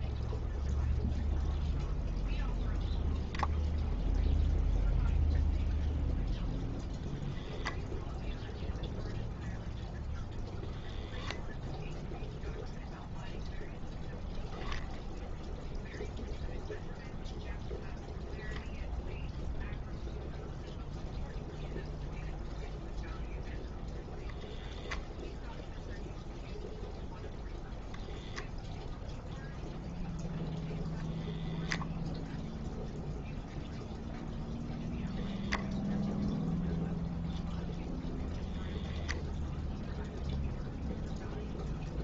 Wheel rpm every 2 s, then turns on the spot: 0, 0, 0, 0, 0, 0, 0, 0, 0, 0, 0, 0, 0, 0, 0, 0, 0, 0, 0, 0, 0.
none